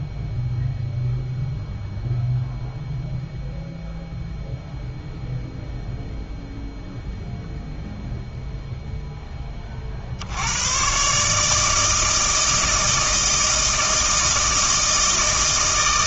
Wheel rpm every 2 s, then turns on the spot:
0, 0, 0, 0, 0, 120, 160, 160.
none